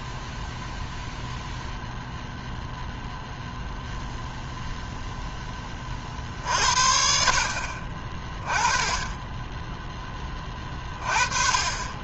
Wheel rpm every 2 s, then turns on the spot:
0, 0, 0, 50, 20, 30.
none